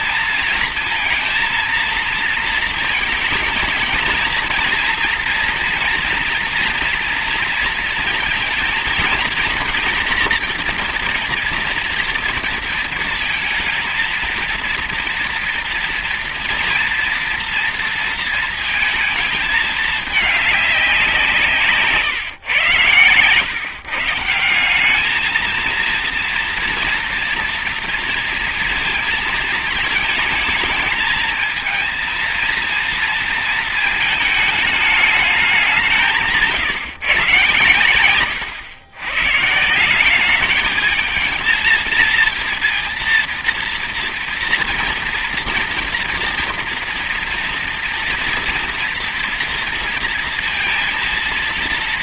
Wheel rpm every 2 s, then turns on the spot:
230, 220, 230, 230, 230, 230, 230, 230, 230, 220, 190, 120, 200, 230, 230, 220, 230, 210, 140, 120, 220, 230, 230, 230, 240, 230.
none